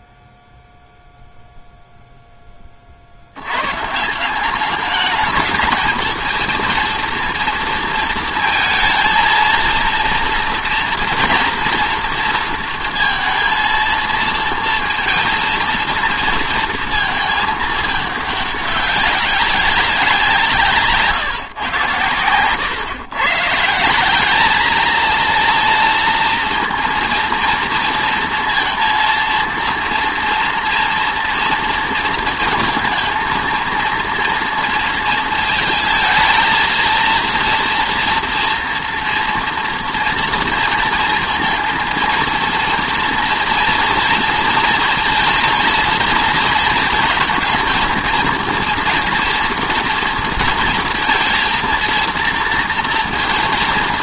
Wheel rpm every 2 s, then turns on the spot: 0, 20, 200, 230, 230, 230, 230, 230, 230, 200, 160, 120, 220, 230, 230, 230, 230, 230, 230, 240, 230, 230, 230, 230, 230, 230, 230.
none